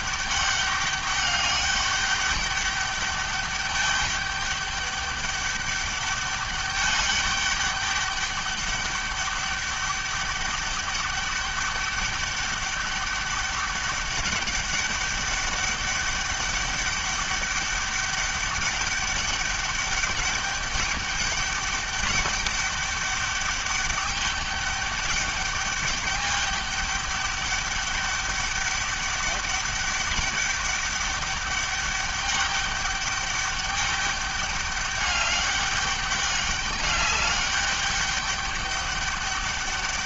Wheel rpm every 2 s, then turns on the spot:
200, 200, 210, 200, 200, 200, 200, 200, 200, 200, 210, 200, 200, 200, 200, 200, 200, 200, 200, 200.
none